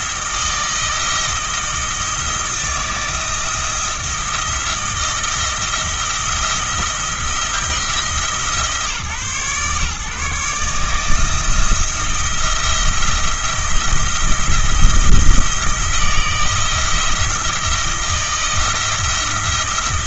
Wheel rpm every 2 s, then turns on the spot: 160, 160, 170, 170, 150, 150, 170, 170, 160, 170.
none